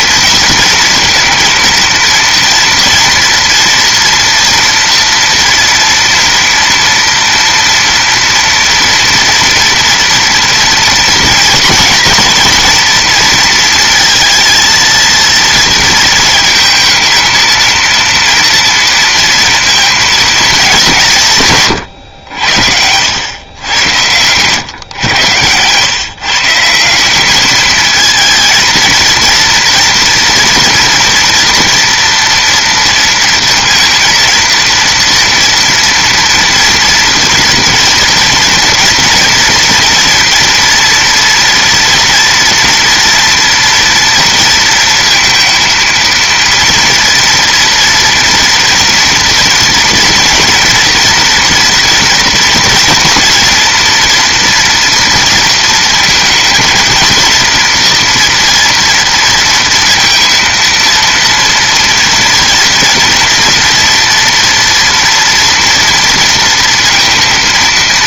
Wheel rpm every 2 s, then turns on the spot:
230, 230, 230, 230, 230, 240, 230, 220, 230, 230, 200, 80, 120, 160, 230, 230, 230, 230, 230, 230, 230, 240, 230, 230, 240, 240, 240, 230, 230, 240, 230, 230, 230, 230.
none